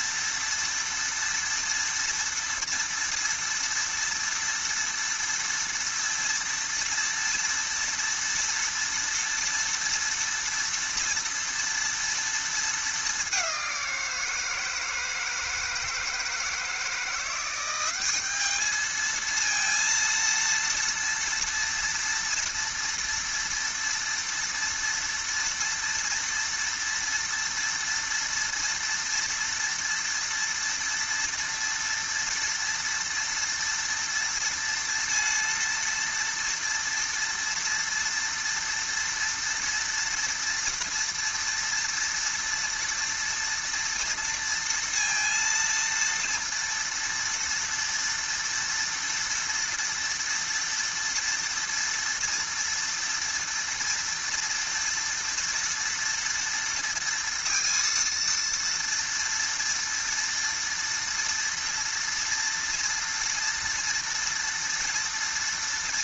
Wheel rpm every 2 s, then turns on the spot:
230, 230, 230, 230, 230, 230, 220, 160, 160, 210, 230, 230, 230, 230, 230, 230, 230, 230, 240, 230, 230, 230, 230, 230, 230, 230, 230, 230, 230, 230, 230, 230, 230.
none